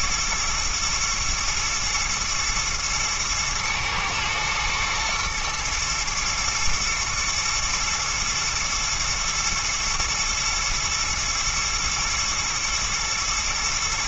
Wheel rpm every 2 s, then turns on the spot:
120, 120, 120, 110, 110, 110, 110.
none